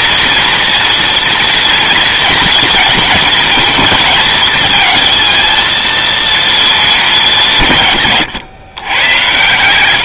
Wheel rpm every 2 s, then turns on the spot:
230, 230, 220, 220, 120.
none